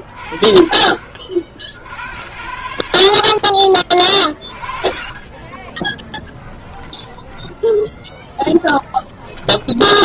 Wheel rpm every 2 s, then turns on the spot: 70, 30, 10, 10, 10.
4-10